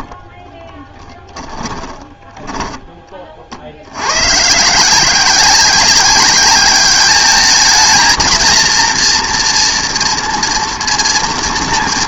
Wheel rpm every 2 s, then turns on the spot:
20, 10, 140, 200, 230, 230.
0-4